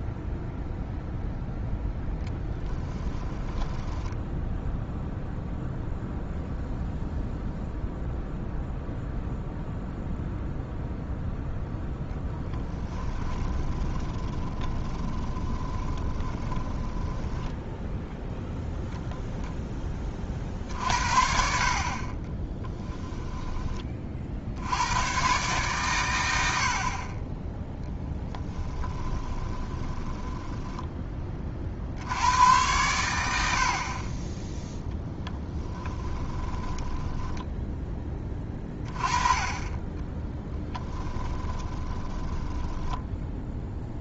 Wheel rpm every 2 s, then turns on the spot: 0, 20, 0, 0, 0, 0, 20, 20, 20, 0, 60, 10, 90, 60, 20, 10, 100, 10, 10, 20, 10, 10.
2-4 12-18 22-24 28-30 36-38 40-44